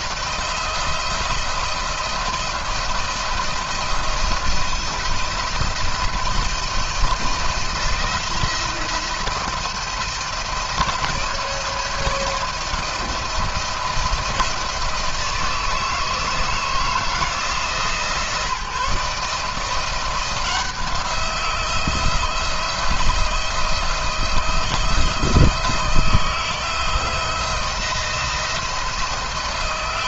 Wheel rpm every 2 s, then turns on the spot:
170, 170, 170, 160, 170, 170, 170, 160, 160, 160, 170, 170, 170, 170, 170.
none